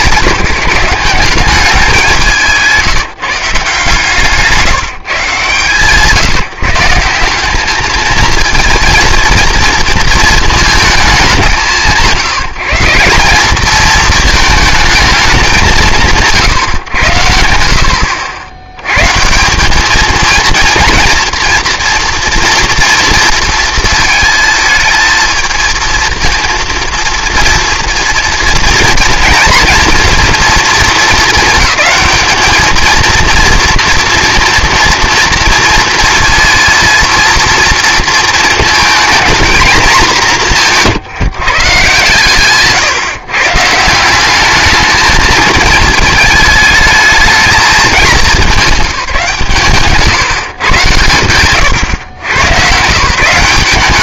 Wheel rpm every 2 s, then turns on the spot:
170, 180, 160, 160, 230, 230, 160, 220, 130, 100, 230, 230, 220, 230, 230, 230, 220, 230, 230, 230, 160, 140, 200, 210, 190, 130, 130.
2-4